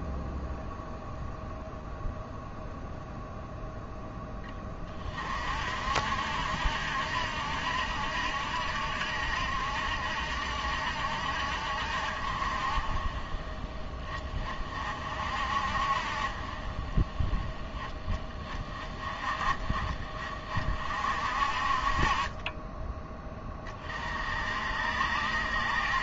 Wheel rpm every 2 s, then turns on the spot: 0, 0, 30, 70, 70, 60, 40, 40, 20, 30, 50, 20, 60.
22-24